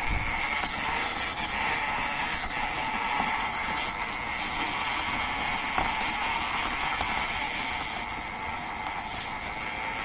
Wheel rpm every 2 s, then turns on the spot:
30, 30, 30, 30, 20.
none